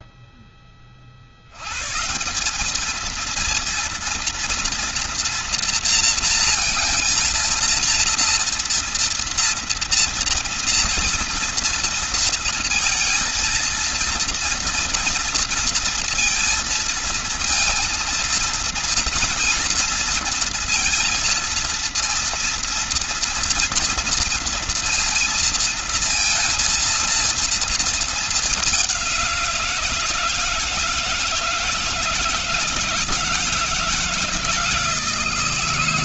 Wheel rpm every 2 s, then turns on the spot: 60, 220, 230, 230, 230, 230, 230, 230, 230, 230, 230, 230, 230, 230, 190, 160, 160, 160.
none